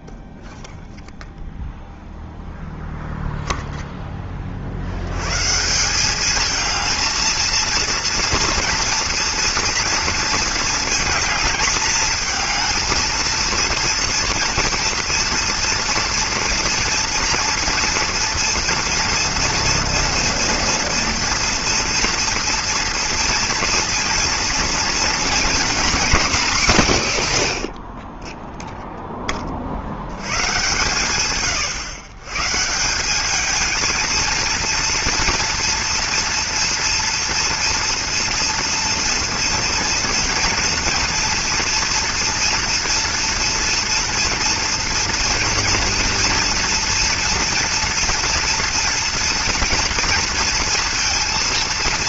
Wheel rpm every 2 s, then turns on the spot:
0, 0, 50, 220, 230, 220, 220, 230, 230, 230, 240, 230, 230, 210, 0, 120, 160, 230, 230, 230, 230, 230, 230, 230, 230, 230.
none